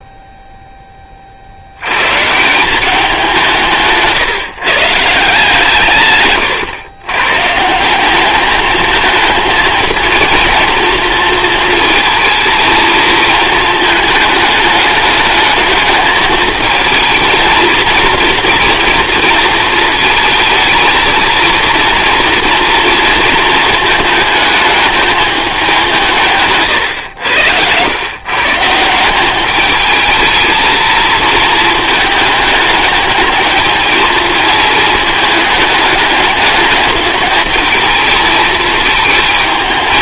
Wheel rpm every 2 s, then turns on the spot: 10, 180, 150, 120, 220, 230, 230, 210, 220, 230, 220, 230, 220, 130, 160, 220, 210, 220, 210, 220.
none